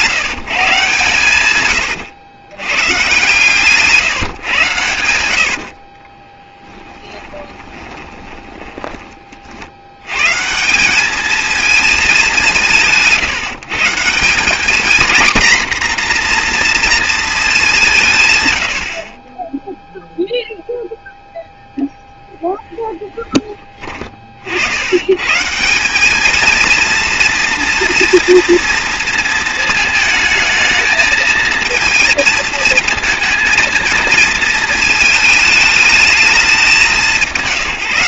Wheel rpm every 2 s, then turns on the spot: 130, 120, 100, 10, 30, 190, 160, 230, 230, 70, 0, 10, 100, 220, 230, 220, 220, 220, 190.
4-10